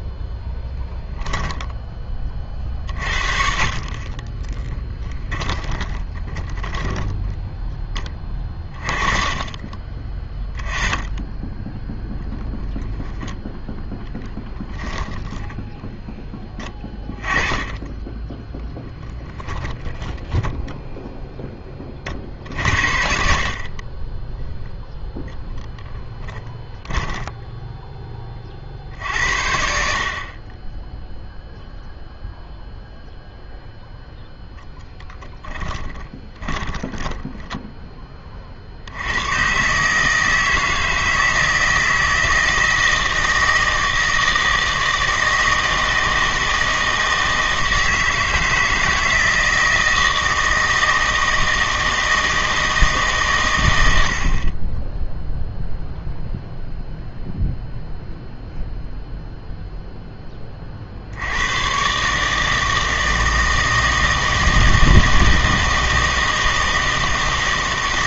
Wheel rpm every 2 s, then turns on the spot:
10, 40, 10, 10, 30, 20, 10, 10, 10, 10, 0, 50, 0, 10, 50, 10, 0, 0, 10, 60, 160, 160, 160, 160, 160, 160, 160, 20, 0, 0, 40, 160, 160, 160.
0-2 4-8 14-16 18-20 26-28 36-38